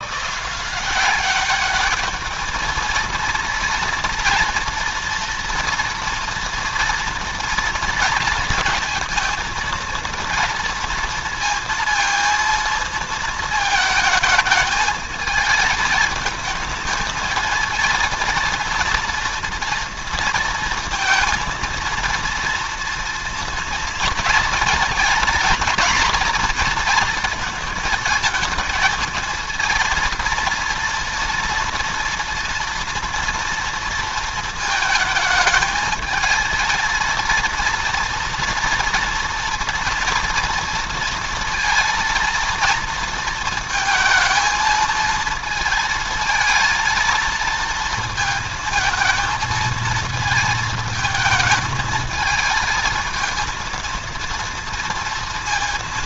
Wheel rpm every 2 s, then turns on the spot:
180, 230, 230, 230, 230, 230, 230, 220, 220, 230, 230, 230, 230, 230, 230, 230, 230, 220, 230, 230, 230, 230, 220, 230, 220, 220, 220, 230.
none